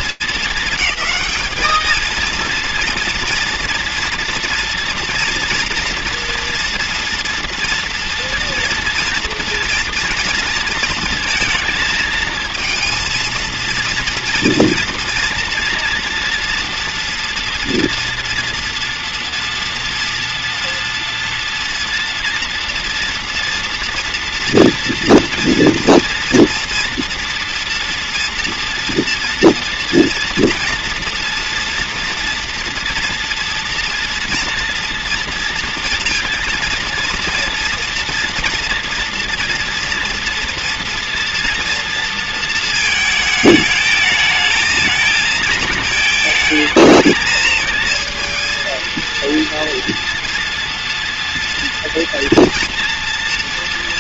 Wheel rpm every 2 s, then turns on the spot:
220, 230, 230, 230, 230, 230, 230, 230, 230, 230, 230, 230, 230, 230, 230, 240, 240, 230, 230, 230, 240, 220, 220, 220, 230, 230, 230.
none